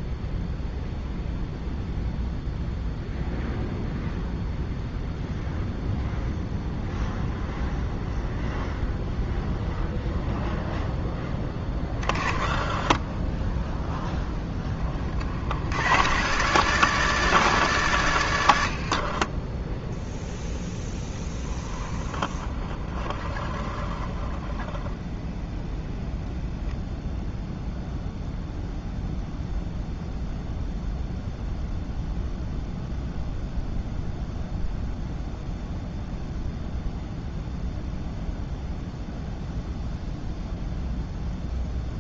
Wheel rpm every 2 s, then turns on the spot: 0, 0, 0, 0, 0, 0, 10, 10, 120, 80, 0, 20, 0, 0, 0, 0, 0, 0, 0, 0, 0.
12-14 18-20